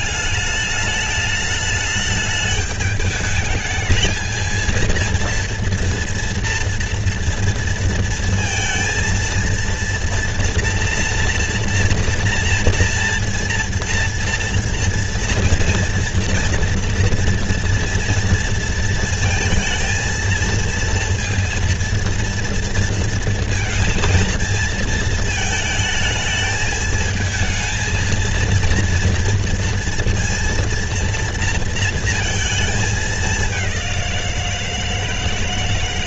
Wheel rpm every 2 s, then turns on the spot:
210, 210, 220, 230, 230, 240, 230, 230, 240, 230, 230, 230, 230, 220, 230, 230, 220, 170.
none